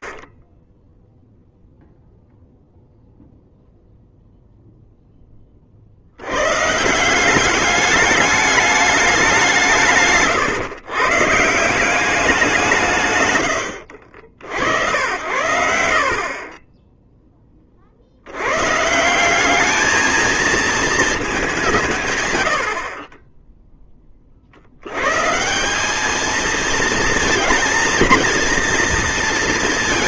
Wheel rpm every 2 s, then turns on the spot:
0, 0, 30, 190, 180, 170, 80, 70, 10, 190, 200, 20, 120, 230, 230.
12-14